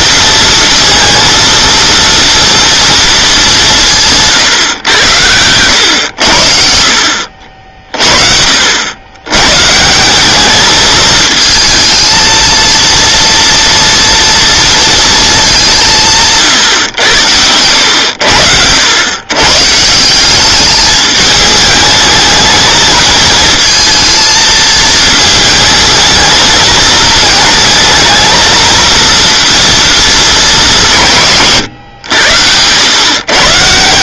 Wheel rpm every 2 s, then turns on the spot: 230, 230, 120, 70, 70, 210, 230, 230, 120, 80, 210, 220, 220, 220, 230, 190, 100.
none